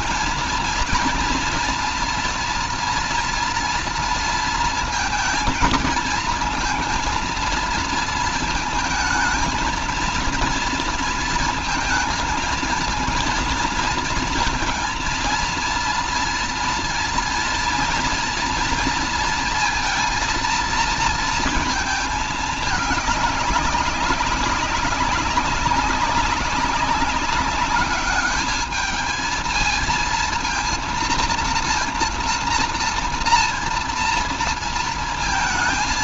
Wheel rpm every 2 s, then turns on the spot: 230, 230, 230, 230, 230, 230, 230, 230, 230, 230, 230, 210, 200, 200, 210, 230, 230, 230.
none